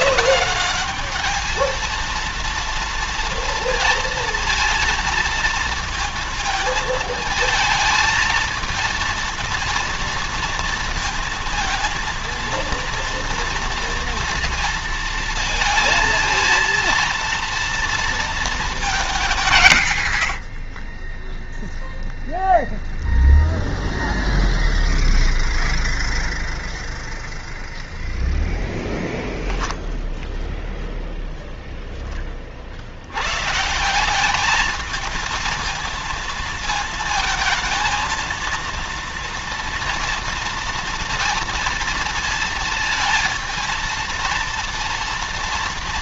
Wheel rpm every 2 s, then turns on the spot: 210, 230, 230, 220, 230, 230, 230, 230, 230, 210, 40, 0, 0, 0, 0, 0, 70, 220, 220, 230, 230, 230, 230.
none